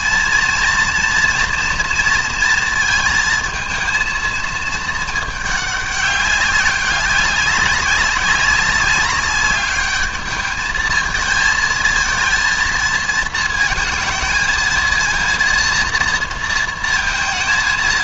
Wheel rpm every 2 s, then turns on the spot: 230, 230, 220, 200, 200, 210, 220, 230, 230.
none